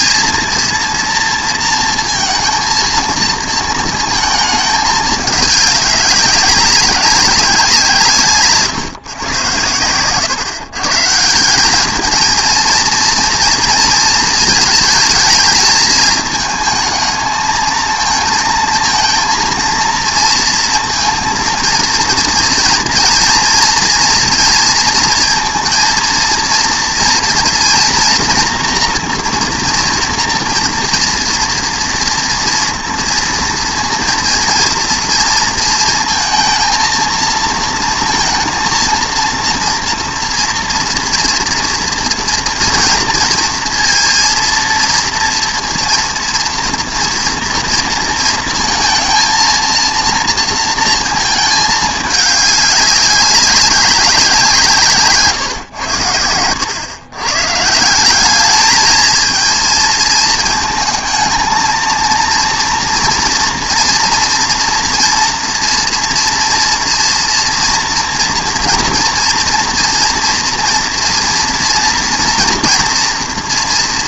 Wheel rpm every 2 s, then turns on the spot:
230, 230, 210, 190, 150, 140, 230, 220, 220, 230, 230, 240, 230, 230, 230, 230, 230, 230, 230, 230, 230, 230, 230, 230, 220, 230, 200, 170, 120, 220, 220, 230, 240, 240, 240, 230, 230.
none